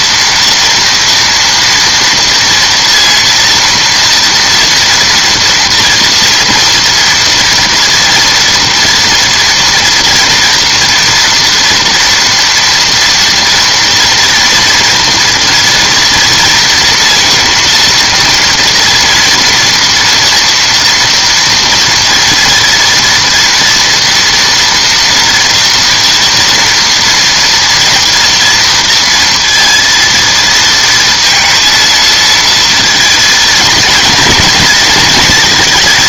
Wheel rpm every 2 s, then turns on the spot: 230, 230, 230, 230, 230, 230, 230, 230, 230, 230, 230, 230, 230, 230, 230, 230, 230, 230.
none